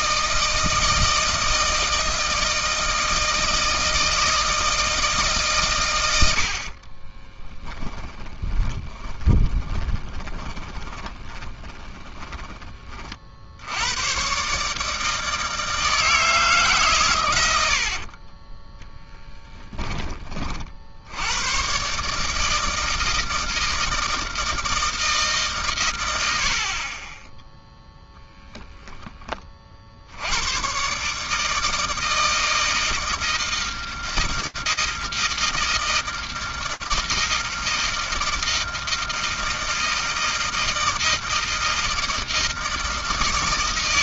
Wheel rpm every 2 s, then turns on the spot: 160, 160, 160, 40, 20, 20, 20, 150, 140, 20, 40, 160, 160, 60, 0, 120, 160, 160, 160, 160, 160, 160.
6-12 18-20 26-28